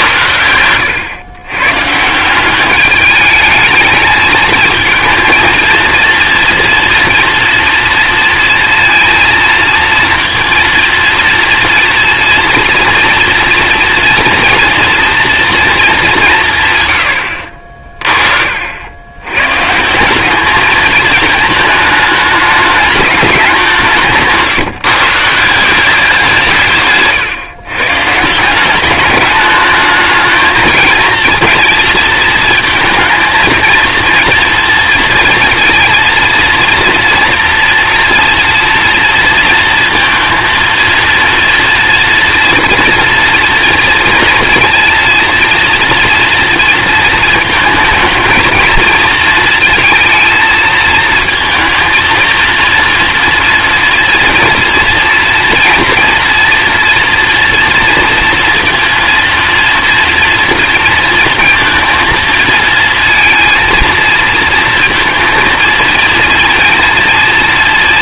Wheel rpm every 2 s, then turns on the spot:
100, 180, 220, 230, 230, 230, 230, 230, 180, 50, 210, 210, 150, 160, 180, 220, 230, 230, 230, 230, 230, 240, 230, 230, 220, 220, 230, 230, 230, 230, 230, 230, 230, 230.
none